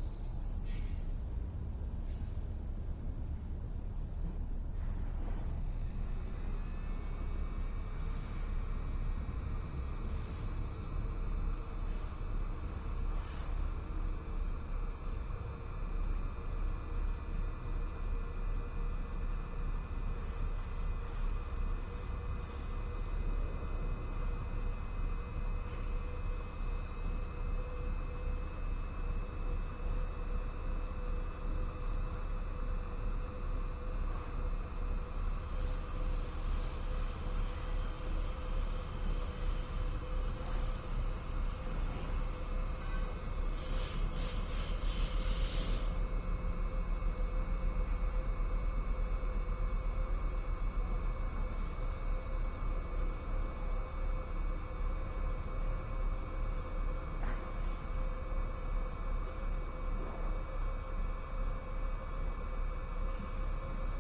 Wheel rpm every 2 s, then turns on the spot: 0, 0, 0, 0, 0, 0, 0, 0, 0, 0, 0, 0, 0, 0, 0, 0, 0, 0, 0, 0, 0, 0, 0, 0, 0, 0, 0, 0, 0, 0, 0, 0.
none